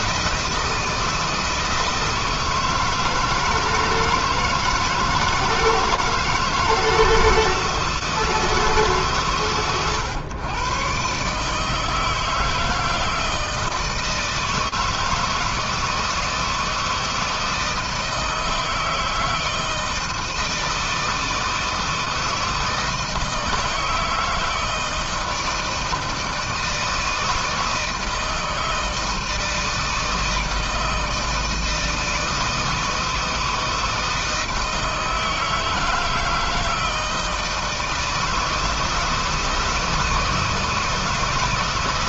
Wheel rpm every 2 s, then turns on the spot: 160, 160, 160, 160, 150, 130, 160, 160, 160, 160, 160, 160, 160, 160, 160, 160, 160, 160, 160, 160, 160.
none